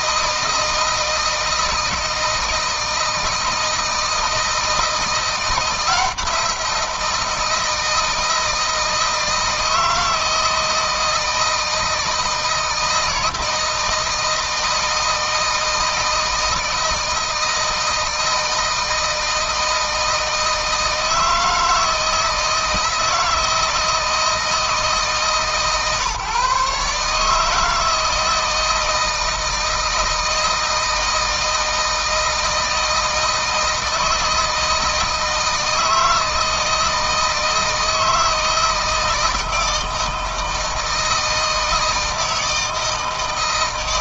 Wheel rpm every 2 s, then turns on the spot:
160, 160, 170, 170, 160, 160, 160, 160, 160, 160, 160, 160, 160, 150, 160, 160, 160, 160, 160, 160, 160, 160.
none